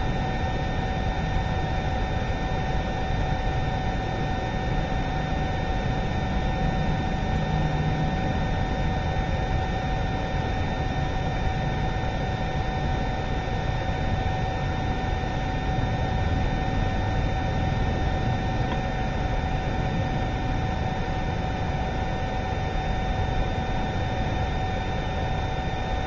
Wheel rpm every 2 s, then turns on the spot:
0, 0, 0, 0, 0, 0, 0, 0, 0, 0, 0, 0, 0.
none